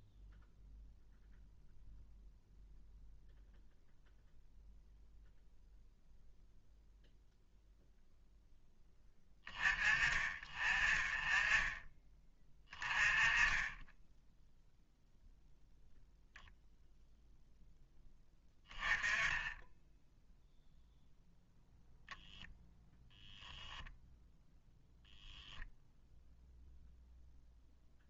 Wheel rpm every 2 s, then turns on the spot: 0, 0, 0, 10, 30, 20, 0, 0, 10, 0, 0, 0, 0, 0.
none